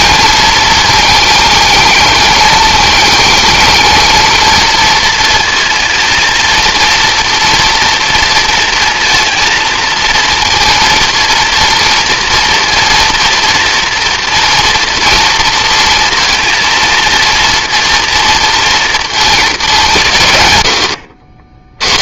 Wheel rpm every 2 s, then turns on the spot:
220, 220, 230, 230, 230, 230, 230, 230, 230, 230, 110.
none